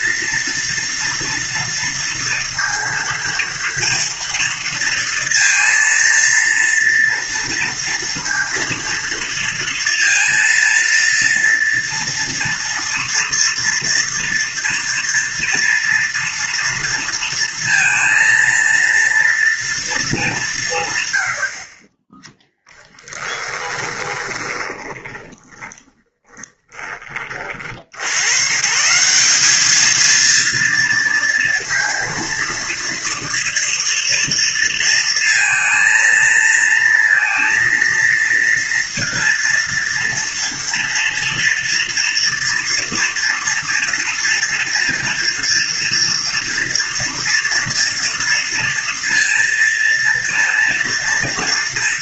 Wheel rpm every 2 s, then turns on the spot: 240, 230, 230, 230, 230, 230, 230, 230, 230, 230, 170, 10, 20, 30, 130, 230, 230, 230, 230, 230, 230, 240, 230, 230, 230, 230.
22-28